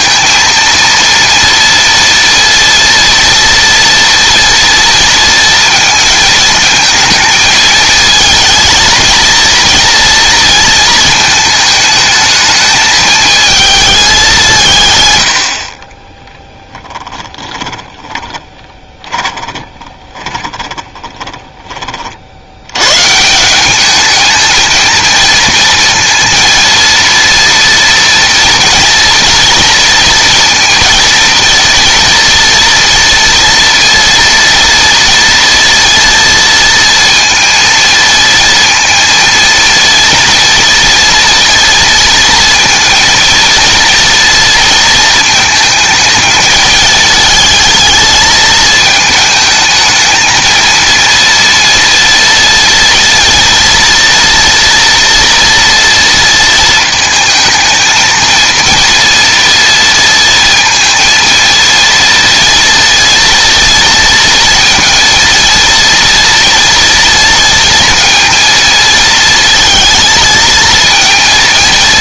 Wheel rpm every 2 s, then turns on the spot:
230, 230, 230, 220, 230, 230, 220, 140, 10, 20, 20, 120, 230, 230, 240, 230, 230, 230, 230, 230, 230, 230, 230, 220, 220, 230, 230, 230, 220, 230, 230, 230, 230, 230, 230, 230.
16-22